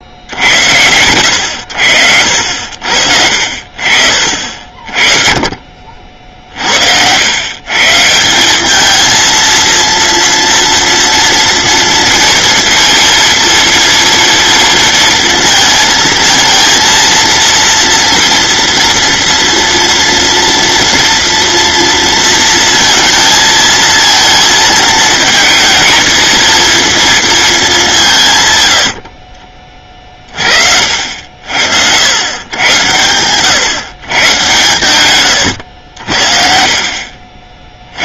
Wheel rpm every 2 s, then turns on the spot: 100, 70, 50, 80, 210, 230, 230, 230, 230, 240, 230, 230, 220, 230, 80, 60, 120, 120, 50.
28-30 34-36